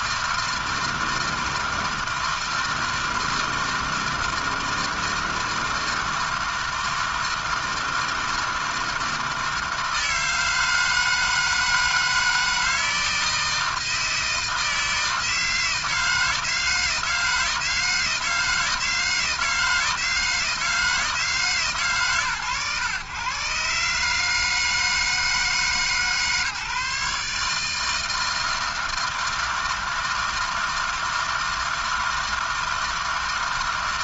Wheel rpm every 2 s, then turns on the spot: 160, 160, 160, 160, 160, 160, 160, 160, 160, 160, 160, 110, 160, 150, 160, 160, 160.
none